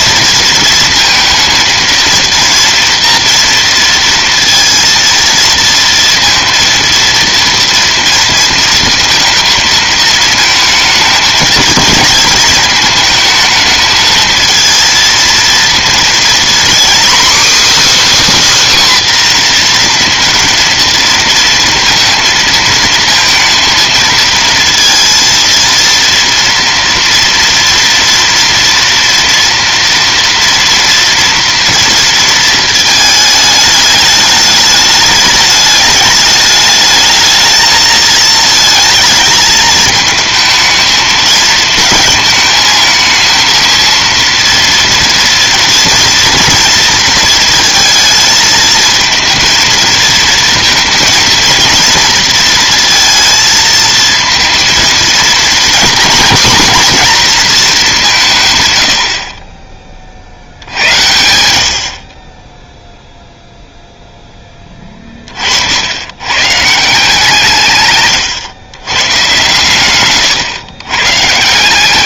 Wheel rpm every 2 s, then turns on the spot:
230, 230, 230, 230, 220, 220, 230, 230, 250, 300, 230, 220, 230, 230, 230, 230, 220, 210, 210, 220, 220, 220, 230, 230, 220, 230, 230, 230, 240, 130, 60, 10, 10, 120, 120, 120.
none